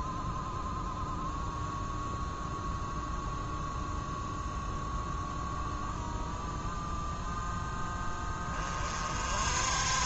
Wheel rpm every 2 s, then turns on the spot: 0, 0, 0, 0, 40.
none